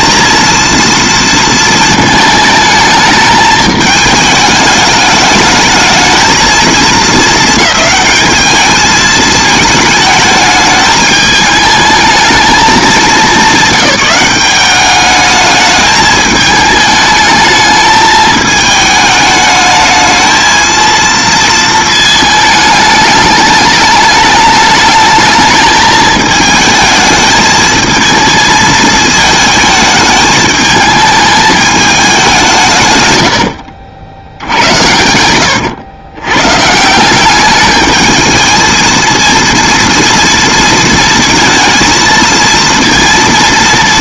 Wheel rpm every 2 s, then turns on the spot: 230, 220, 210, 220, 210, 210, 210, 190, 210, 210, 220, 220, 210, 220, 220, 220, 150, 80, 150, 230, 230, 230.
34-36